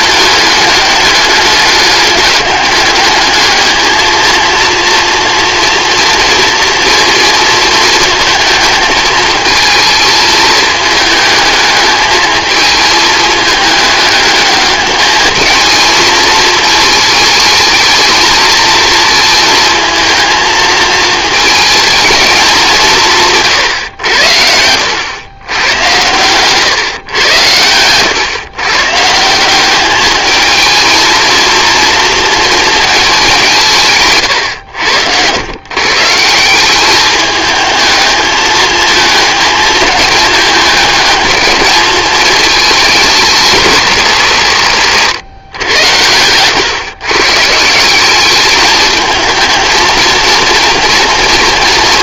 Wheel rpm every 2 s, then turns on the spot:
210, 200, 230, 230, 220, 220, 220, 210, 220, 230, 220, 190, 80, 130, 130, 220, 230, 110, 190, 220, 210, 220, 160, 110, 210, 230.
26-28 34-36